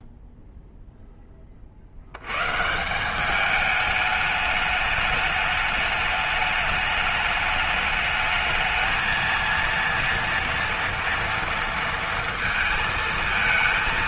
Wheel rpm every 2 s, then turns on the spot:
10, 190, 210, 210, 230, 230, 230.
none